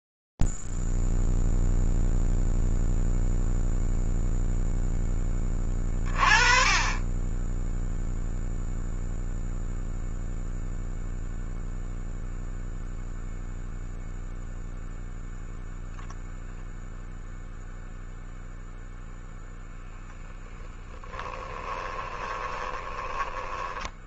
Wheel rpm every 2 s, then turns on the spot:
0, 0, 0, 30, 0, 0, 0, 0, 0, 0, 10, 20.
22-24